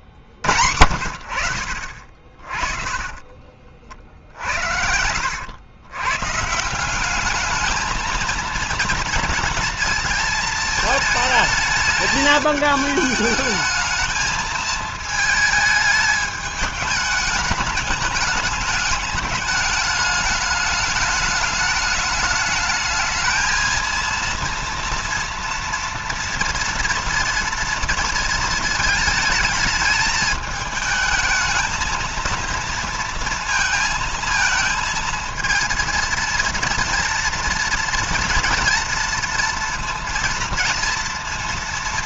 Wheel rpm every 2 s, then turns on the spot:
70, 40, 70, 170, 230, 220, 220, 220, 210, 210, 210, 220, 230, 230, 220, 220, 230, 220, 230, 230, 230.
2-4